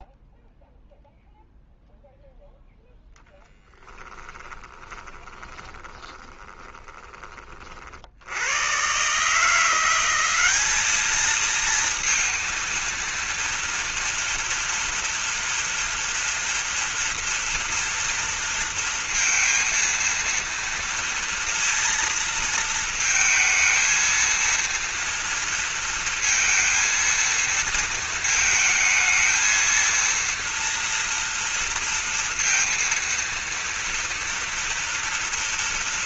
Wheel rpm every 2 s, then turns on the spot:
0, 0, 20, 20, 110, 210, 230, 230, 230, 230, 230, 230, 230, 230, 220, 230, 230, 230.
4-8